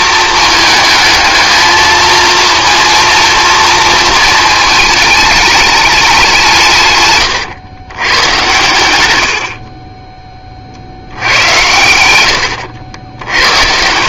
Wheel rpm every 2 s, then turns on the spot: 220, 230, 220, 150, 110, 50, 80.
12-14